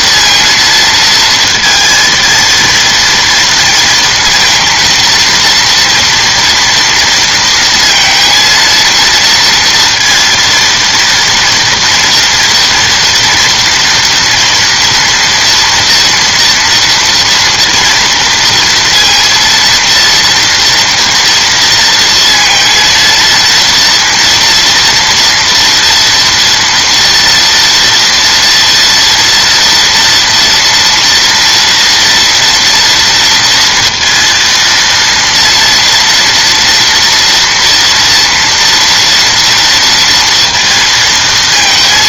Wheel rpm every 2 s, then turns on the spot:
230, 230, 230, 230, 230, 230, 240, 230, 240, 230, 230, 230, 230, 230, 230, 230, 230, 230, 230, 240, 230.
none